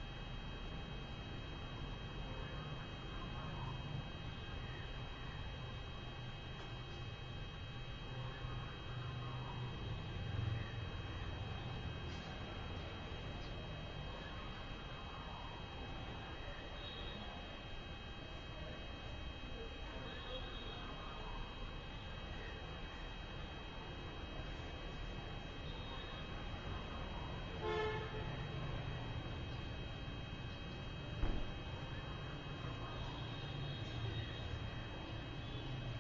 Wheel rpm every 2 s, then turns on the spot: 0, 0, 0, 0, 0, 0, 0, 0, 0, 0, 0, 0, 0, 0, 0, 0, 0, 0.
none